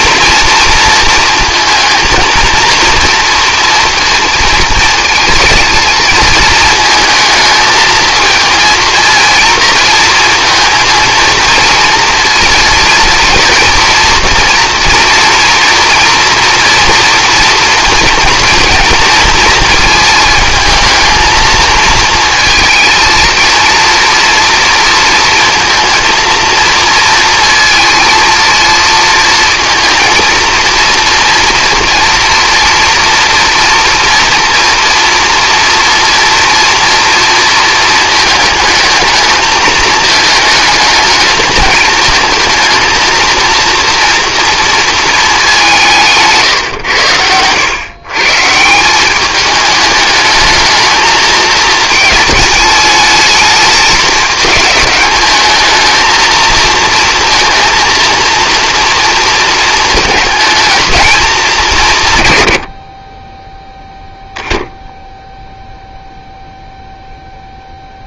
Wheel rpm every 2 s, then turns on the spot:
230, 230, 230, 220, 230, 230, 220, 230, 230, 230, 220, 220, 230, 230, 230, 230, 240, 230, 240, 220, 210, 220, 230, 120, 170, 220, 210, 210, 230, 230, 220, 80, 10, 0.
none